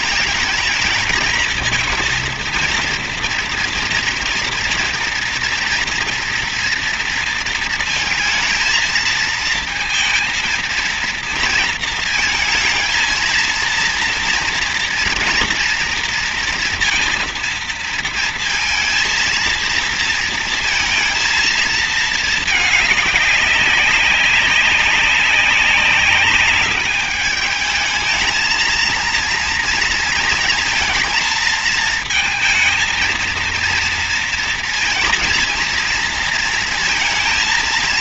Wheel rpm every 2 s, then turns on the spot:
220, 230, 230, 230, 230, 230, 220, 230, 230, 230, 230, 220, 190, 200, 220, 230, 220, 230, 230.
none